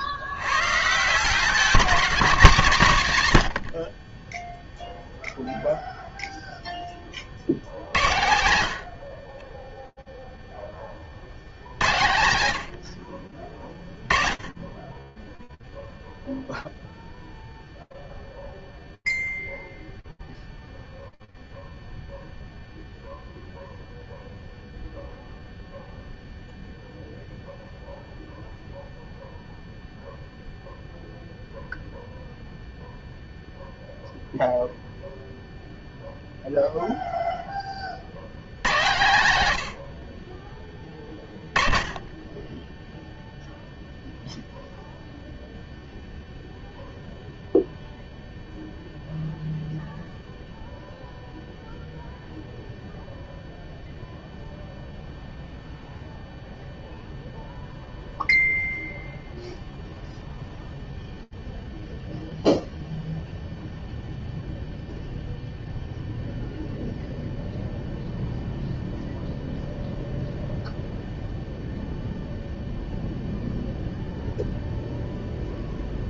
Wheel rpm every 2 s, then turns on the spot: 120, 190, 0, 0, 80, 50, 50, 10, 0, 0, 0, 0, 0, 0, 0, 0, 0, 0, 30, 80, 20, 0, 0, 0, 0, 0, 0, 0, 0, 0, 0, 0, 0, 0, 0, 0, 0, 0.
none